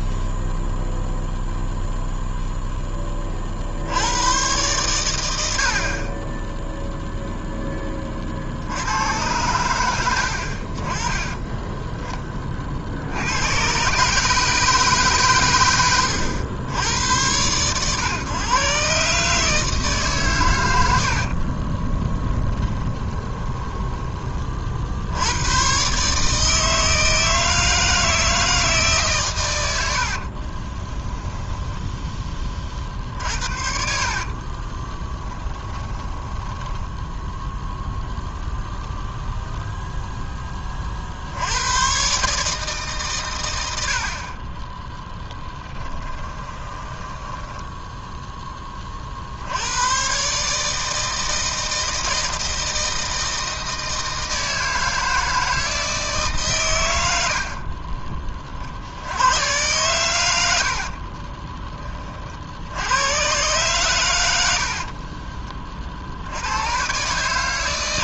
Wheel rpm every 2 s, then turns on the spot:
0, 10, 110, 10, 70, 40, 50, 150, 100, 130, 100, 20, 50, 160, 160, 30, 40, 30, 10, 0, 30, 150, 20, 20, 20, 150, 160, 160, 120, 50, 80, 80, 60, 110.
22-24 30-32 34-38 46-48 60-62 64-66